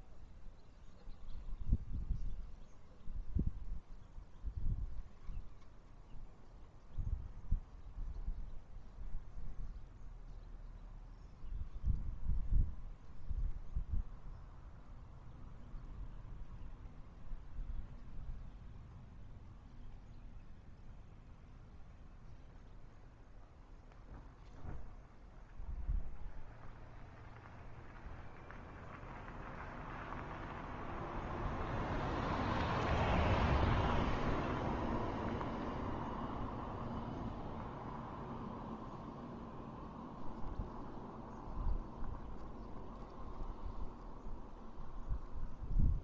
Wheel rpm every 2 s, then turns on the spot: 0, 0, 0, 0, 0, 0, 0, 0, 0, 0, 0, 0, 0, 0, 0, 0, 0, 0, 0, 0, 0, 0, 0.
none